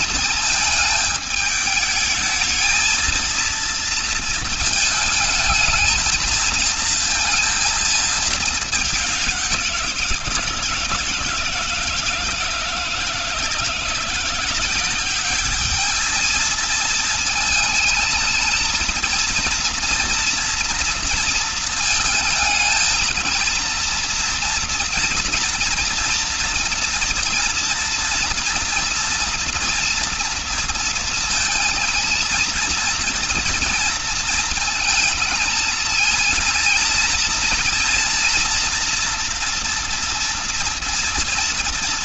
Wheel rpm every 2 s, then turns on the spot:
220, 220, 220, 230, 210, 170, 160, 190, 220, 220, 230, 220, 230, 230, 240, 230, 230, 230, 230, 240, 230.
none